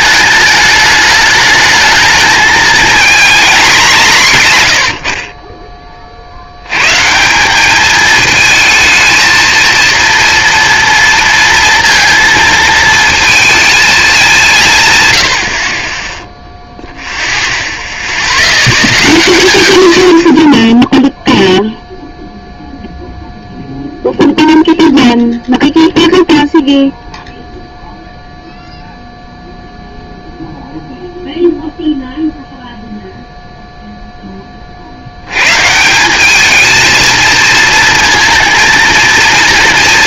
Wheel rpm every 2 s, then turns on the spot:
210, 230, 130, 90, 220, 230, 220, 160, 0, 0, 0, 0, 0, 0, 0, 0, 0, 40, 210, 220.
none